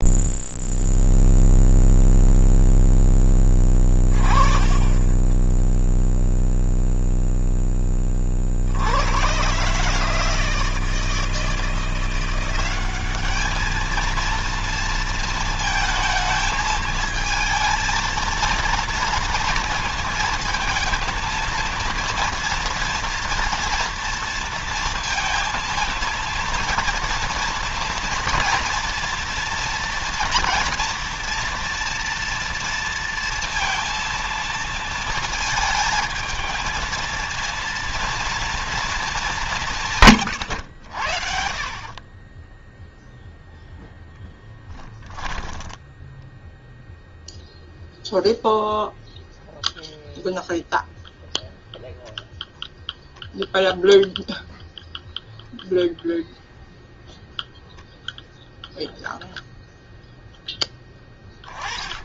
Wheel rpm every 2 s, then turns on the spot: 0, 10, 30, 0, 80, 160, 200, 230, 220, 230, 230, 230, 230, 230, 240, 240, 230, 230, 230, 230, 70, 0, 10, 0, 0, 0, 0, 0, 0, 0, 10.
4-6 44-46